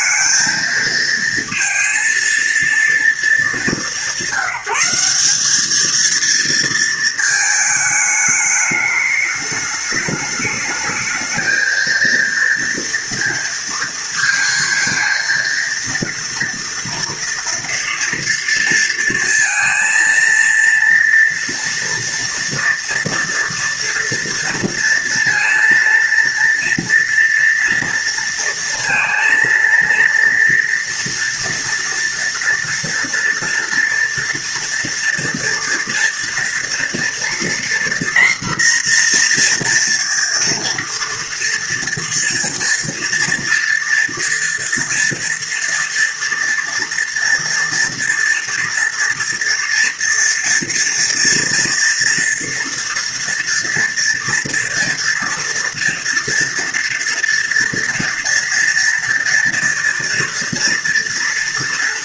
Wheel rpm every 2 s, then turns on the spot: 220, 230, 180, 230, 210, 210, 230, 230, 230, 230, 230, 230, 230, 230, 230, 230, 230, 230, 240, 240, 230, 240, 230, 230, 230, 230, 230, 230, 230, 230, 240.
none